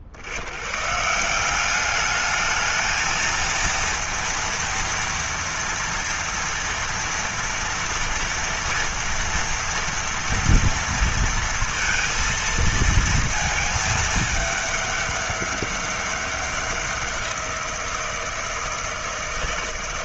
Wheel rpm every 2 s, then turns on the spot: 50, 210, 230, 230, 230, 230, 230, 210, 200, 170.
none